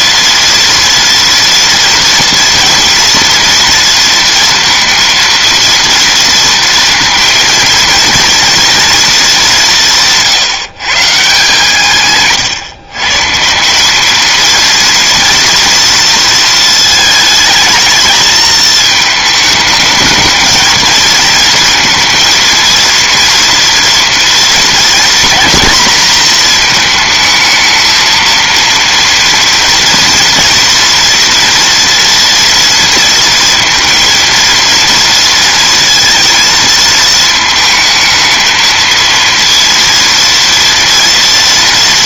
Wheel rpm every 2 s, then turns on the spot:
230, 230, 230, 230, 230, 150, 130, 230, 220, 220, 220, 230, 230, 220, 230, 240, 230, 230, 220, 220, 230.
none